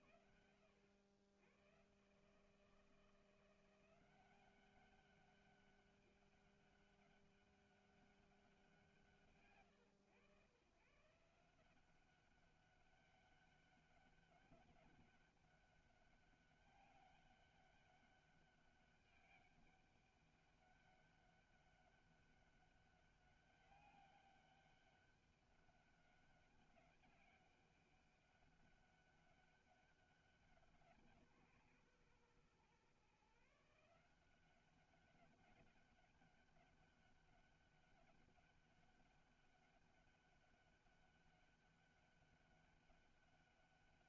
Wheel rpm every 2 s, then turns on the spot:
110, 170, 200, 200, 120, 150, 200, 200, 200, 200, 200, 200, 200, 200, 190, 190, 130, 190, 200, 200, 200, 200.
none